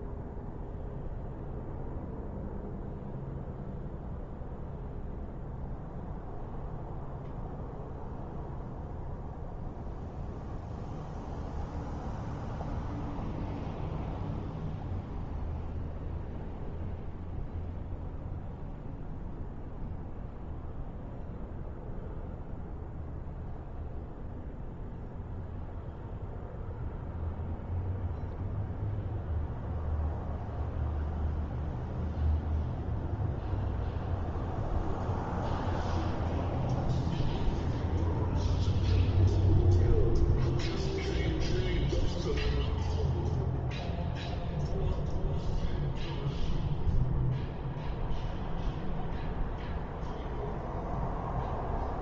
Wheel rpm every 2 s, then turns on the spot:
0, 0, 0, 0, 0, 0, 0, 0, 0, 0, 0, 0, 0, 0, 0, 0, 0, 0, 0, 0, 0, 0, 0, 0, 0, 0.
none